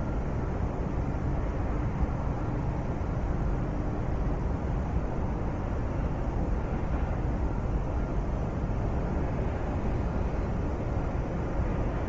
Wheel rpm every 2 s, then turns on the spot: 0, 0, 0, 0, 0, 0.
none